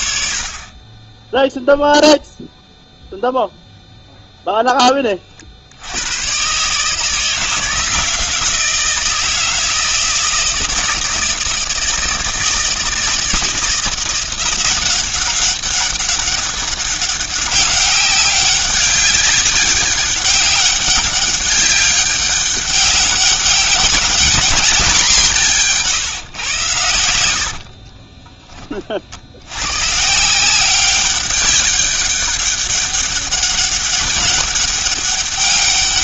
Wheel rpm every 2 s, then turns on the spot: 20, 0, 20, 150, 160, 160, 160, 180, 200, 200, 200, 200, 210, 110, 30, 190, 200, 200.
none